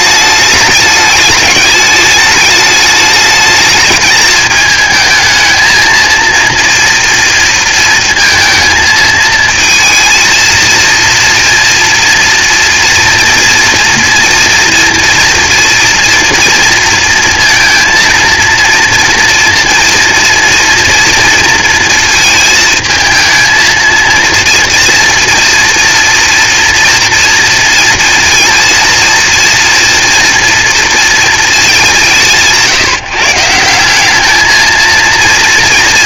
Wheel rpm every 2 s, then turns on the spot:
210, 210, 220, 230, 220, 230, 230, 230, 230, 230, 230, 230, 230, 230, 230, 230, 150, 220.
none